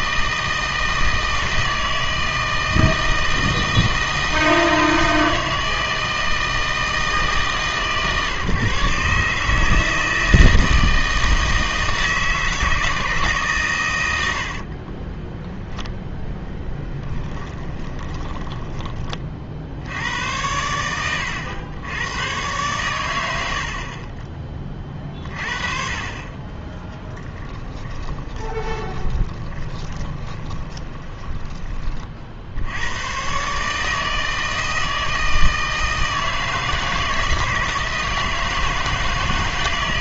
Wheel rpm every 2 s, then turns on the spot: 160, 160, 160, 160, 140, 160, 160, 60, 10, 20, 100, 110, 30, 20, 20, 20, 80, 160, 160, 160.
14-18 26-32